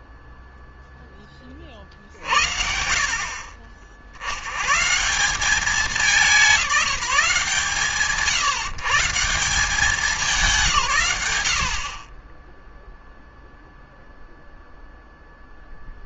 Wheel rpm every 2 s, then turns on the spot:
0, 50, 150, 170, 150, 130, 0, 0.
none